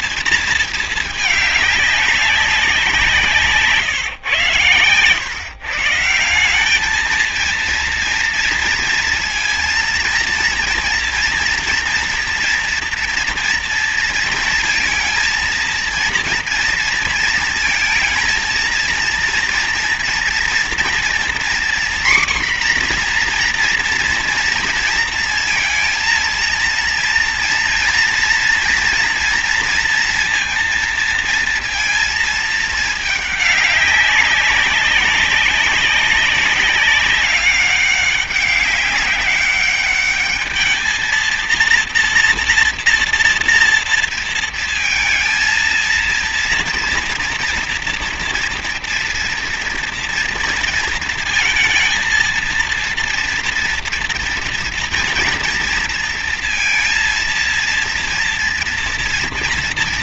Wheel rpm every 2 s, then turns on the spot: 220, 180, 120, 190, 230, 230, 240, 230, 230, 220, 240, 250, 240, 230, 230, 230, 220, 190, 200, 200, 220, 230, 230, 230, 240, 230, 230, 230, 230, 230.
none